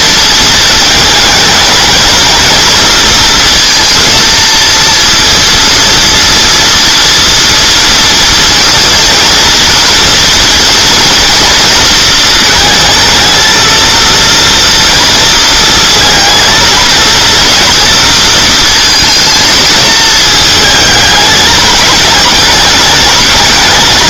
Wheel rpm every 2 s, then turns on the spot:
220, 230, 230, 230, 230, 230, 220, 230, 230, 230, 220, 220.
none